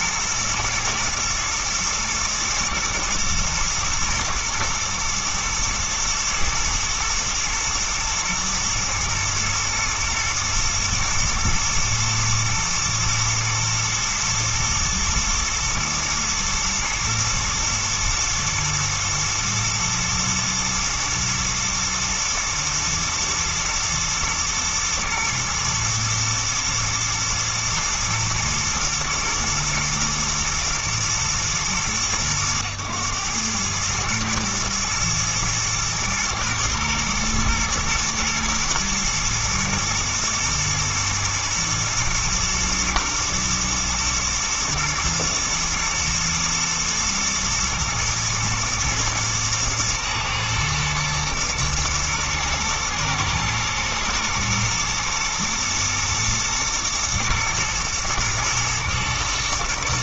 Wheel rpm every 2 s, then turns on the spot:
120, 110, 120, 110, 110, 120, 110, 120, 120, 120, 110, 110, 110, 110, 120, 120, 110, 110, 110, 110, 110, 120, 120, 120, 110, 120, 110, 110, 120, 110.
none